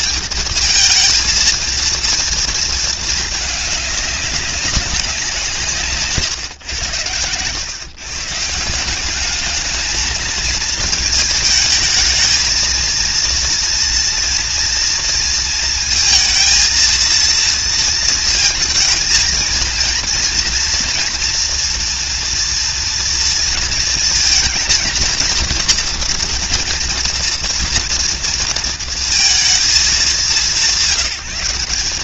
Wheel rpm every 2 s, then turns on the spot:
230, 230, 210, 150, 120, 220, 220, 230, 230, 230, 230, 240, 230, 230, 230, 190.
none